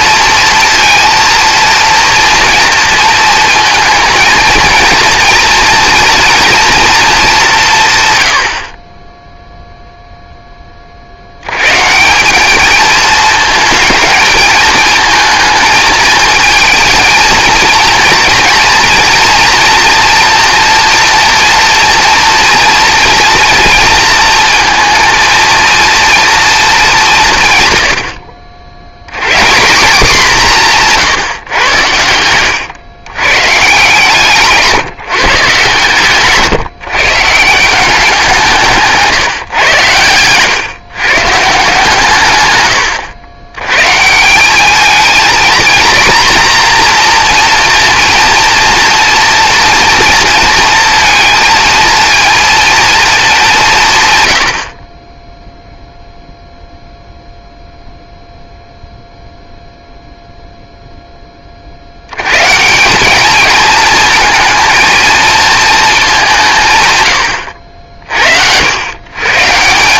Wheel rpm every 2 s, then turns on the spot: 230, 230, 210, 10, 60, 220, 220, 230, 240, 230, 230, 230, 190, 110, 160, 110, 150, 140, 160, 130, 100, 220, 240, 230, 230, 230, 40, 0, 0, 0, 120, 220, 180, 70, 200.
28-30